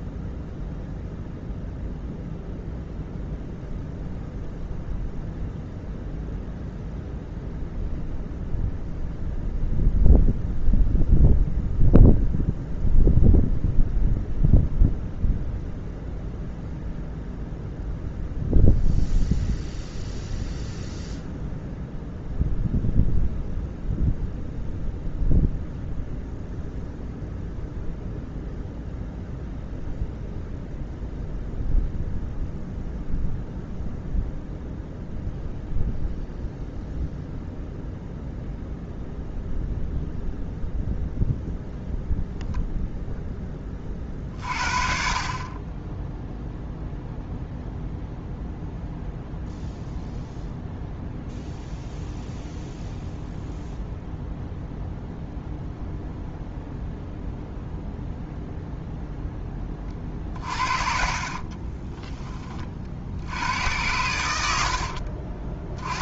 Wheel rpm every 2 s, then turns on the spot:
0, 0, 0, 0, 0, 0, 0, 0, 0, 0, 0, 0, 0, 0, 0, 0, 0, 0, 0, 0, 0, 0, 40, 0, 0, 0, 0, 0, 0, 0, 40, 40, 70.
60-62 64-66